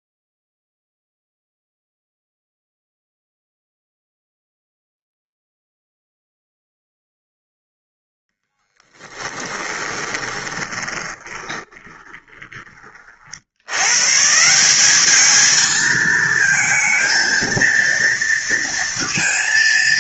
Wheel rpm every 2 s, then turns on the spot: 0, 0, 0, 0, 20, 20, 30, 190, 230, 230.
8-12